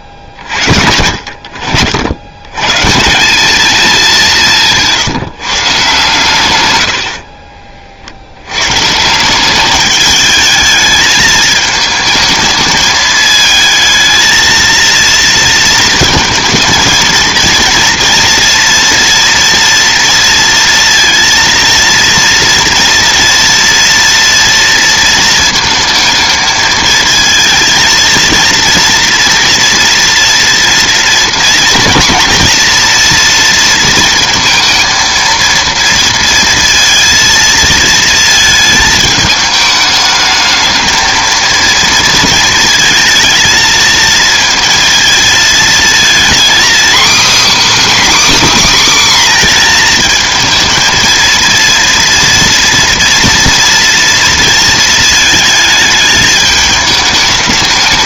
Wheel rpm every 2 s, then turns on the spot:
40, 120, 180, 140, 90, 210, 220, 230, 230, 230, 230, 240, 230, 220, 230, 230, 230, 230, 230, 220, 210, 220, 220, 250, 290, 220, 230, 230, 220.
none